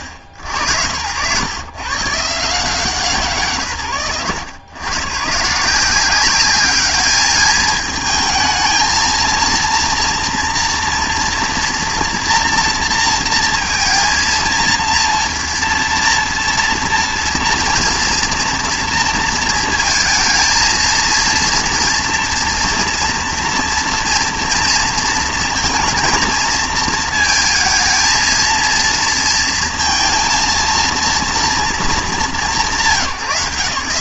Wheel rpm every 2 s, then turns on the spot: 90, 140, 90, 200, 220, 230, 230, 230, 240, 230, 230, 230, 230, 220, 230, 230, 170.
none